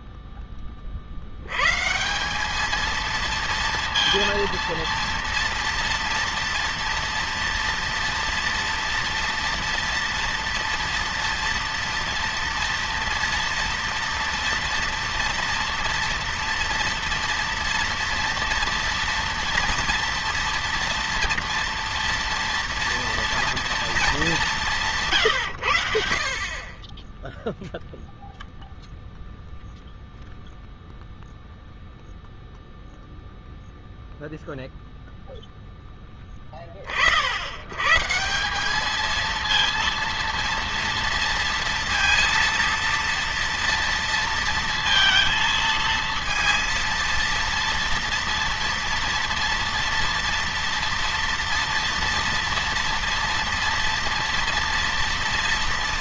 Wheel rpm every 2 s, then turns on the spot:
10, 200, 230, 230, 230, 230, 230, 230, 230, 230, 230, 230, 180, 30, 0, 0, 0, 0, 30, 200, 230, 230, 230, 230, 230, 230, 230, 230.
none